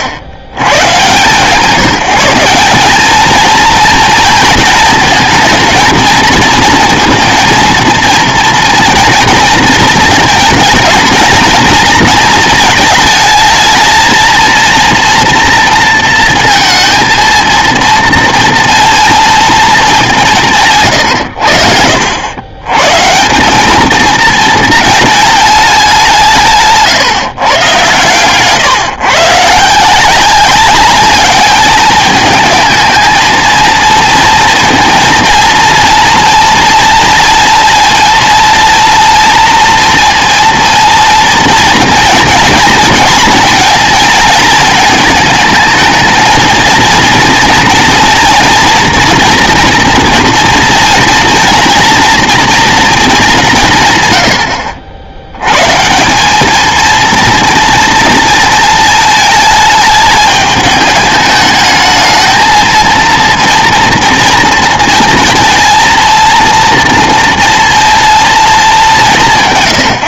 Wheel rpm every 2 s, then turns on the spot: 100, 190, 220, 230, 230, 220, 220, 230, 230, 230, 140, 130, 220, 140, 140, 200, 220, 230, 230, 230, 230, 230, 220, 230, 230, 230, 230, 80, 220, 230, 210, 230, 230, 230, 190.
none